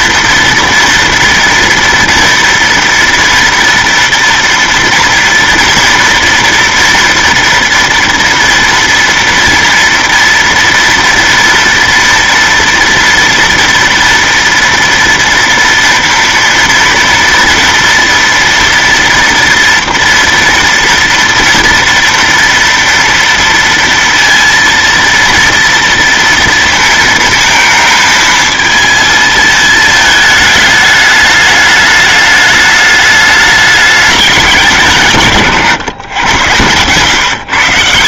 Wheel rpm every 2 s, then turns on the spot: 230, 230, 230, 230, 230, 230, 230, 230, 230, 230, 230, 230, 230, 230, 220, 210, 210, 180, 110.
none